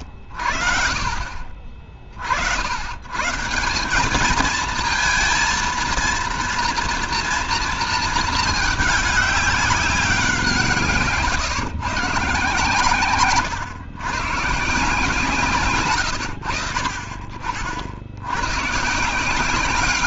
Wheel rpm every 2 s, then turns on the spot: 50, 70, 220, 230, 210, 160, 130, 150, 60, 120.
none